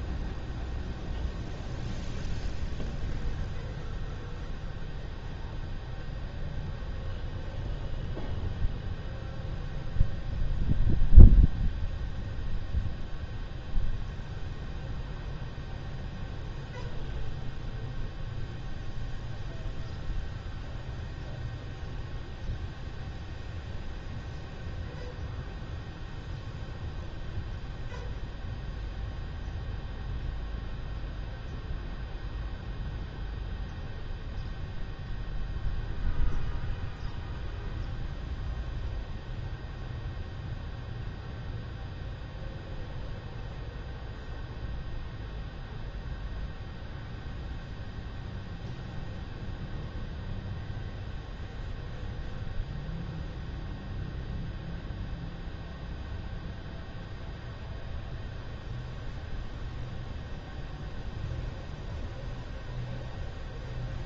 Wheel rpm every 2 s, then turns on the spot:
0, 0, 0, 0, 0, 0, 0, 0, 0, 0, 0, 0, 0, 0, 0, 0, 0, 0, 0, 0, 0, 0, 0, 0, 0, 0, 0, 0, 0, 0, 0, 0.
none